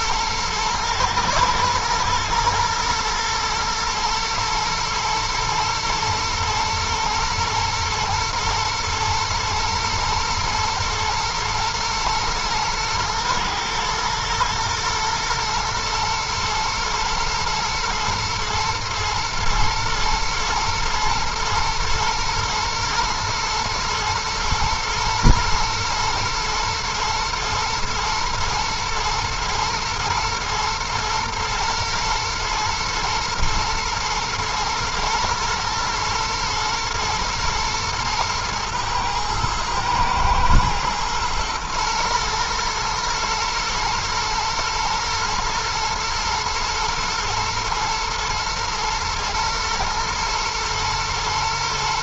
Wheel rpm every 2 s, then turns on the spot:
110, 120, 110, 110, 120, 110, 110, 120, 110, 120, 120, 120, 110, 120, 110, 120, 120, 110, 110, 110, 110, 110, 110, 110, 110, 110.
none